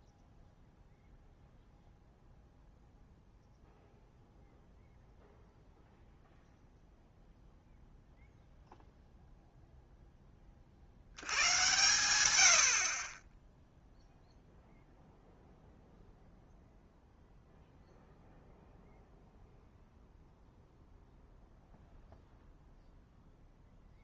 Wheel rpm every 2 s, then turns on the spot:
0, 0, 0, 0, 0, 40, 70, 0, 0, 0, 0, 0.
none